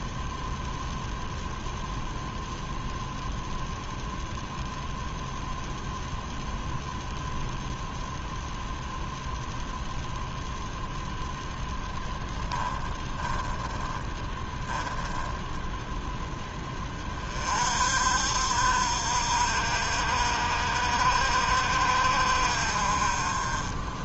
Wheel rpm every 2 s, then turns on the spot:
0, 0, 0, 0, 0, 0, 10, 10, 20, 60, 60, 40.
12-14